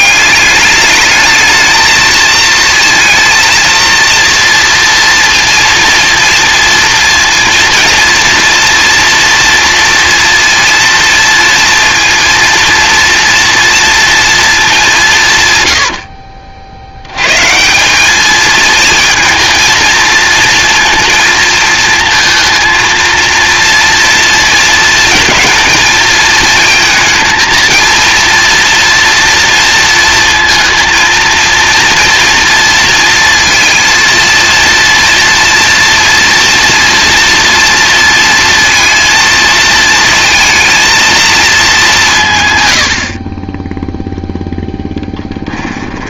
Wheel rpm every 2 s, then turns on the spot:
210, 220, 230, 230, 240, 230, 230, 220, 50, 220, 230, 220, 230, 220, 230, 230, 230, 230, 230, 230, 220, 120, 0.
none